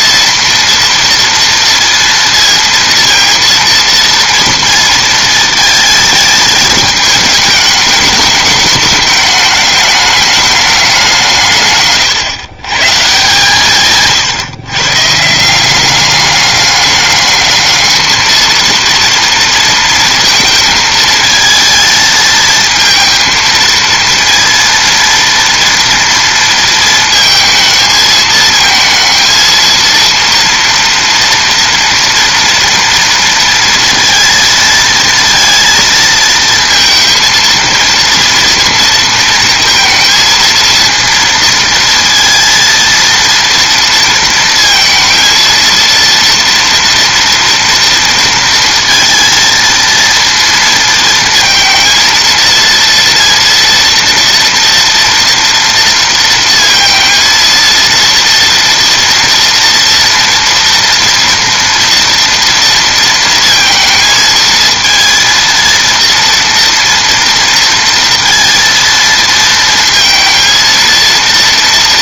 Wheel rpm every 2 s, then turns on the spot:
240, 230, 230, 220, 210, 190, 140, 140, 200, 230, 220, 220, 230, 230, 220, 230, 230, 230, 230, 230, 230, 230, 230, 230, 230, 230, 230, 230, 230, 230, 230, 230, 230, 230, 230, 230.
none